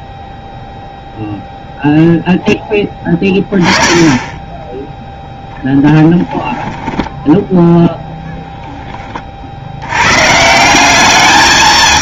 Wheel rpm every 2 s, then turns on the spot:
0, 10, 0, 10, 10, 200.
6-8